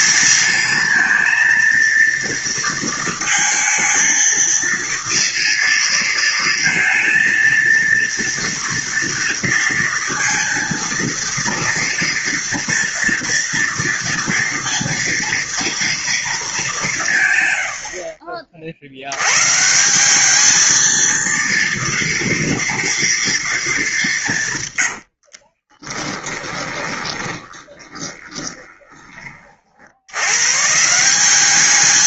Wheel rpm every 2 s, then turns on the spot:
220, 230, 230, 220, 230, 230, 230, 230, 190, 60, 220, 230, 100, 20, 20, 150.
24-30